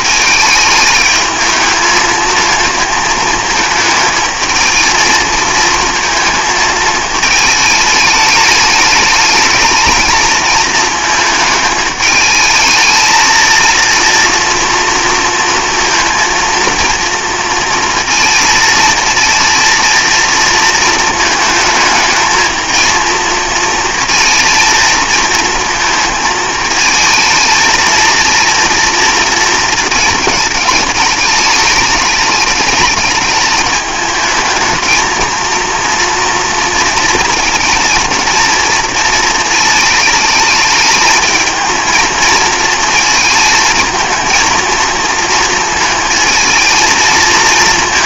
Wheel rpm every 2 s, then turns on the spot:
210, 220, 220, 220, 210, 220, 220, 240, 230, 230, 230, 220, 230, 220, 230, 210, 210, 220, 230, 230, 220, 220, 220, 220.
none